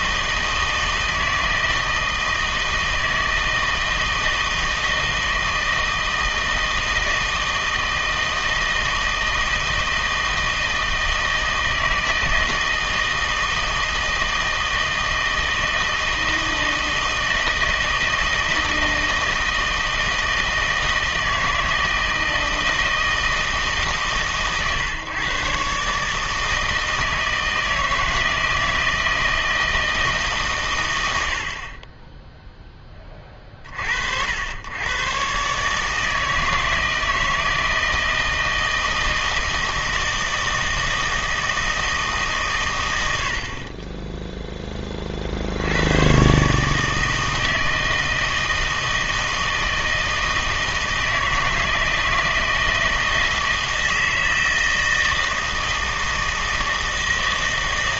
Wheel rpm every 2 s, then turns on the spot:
160, 160, 160, 160, 160, 160, 160, 160, 160, 160, 160, 160, 140, 160, 160, 110, 10, 100, 160, 160, 160, 120, 20, 150, 160, 160, 160, 160, 160.
none